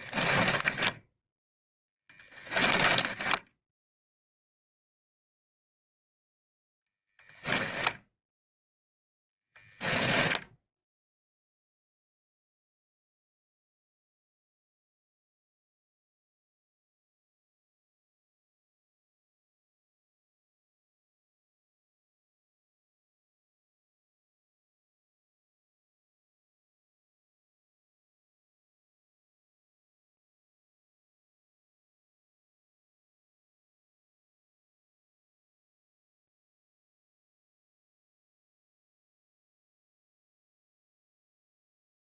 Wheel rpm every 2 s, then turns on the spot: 10, 10, 0, 0, 10, 0, 0, 0, 0, 0, 0, 0, 0, 0, 0, 0, 0, 0, 0, 0, 0.
2-4